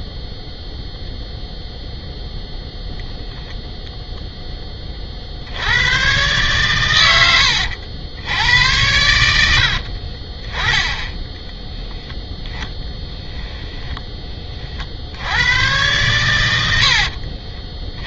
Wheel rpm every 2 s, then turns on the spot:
0, 0, 20, 110, 90, 10, 10, 40, 80.
none